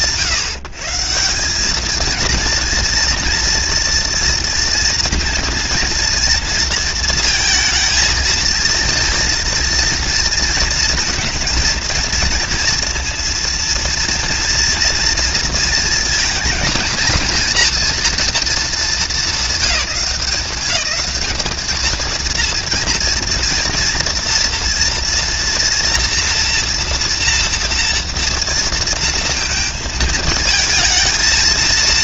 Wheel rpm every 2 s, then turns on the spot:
160, 230, 230, 230, 230, 230, 230, 230, 230, 230, 190, 230, 230, 240, 230, 220.
none